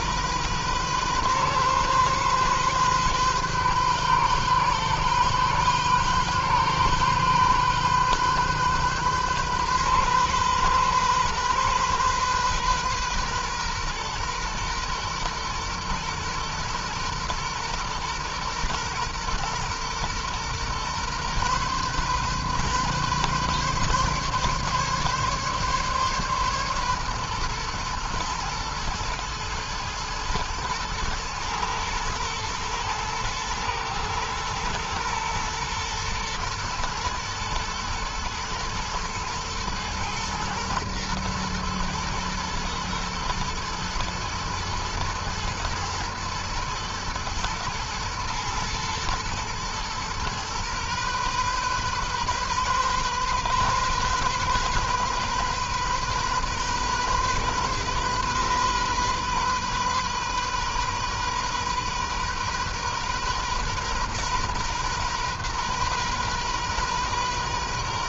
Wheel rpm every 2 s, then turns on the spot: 130, 130, 130, 130, 130, 130, 130, 120, 120, 120, 120, 130, 140, 130, 110, 110, 120, 120, 120, 110, 110, 120, 120, 120, 110, 120, 130, 130, 130, 130, 130, 130, 130, 130.
none